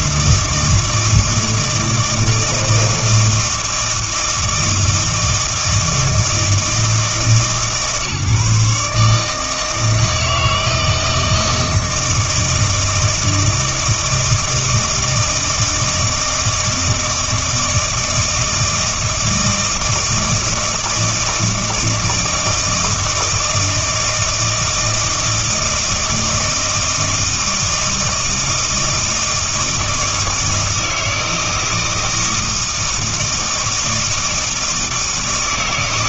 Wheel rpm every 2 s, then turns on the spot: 160, 160, 160, 160, 150, 160, 160, 160, 160, 160, 160, 160, 160, 160, 160, 160, 160, 160.
none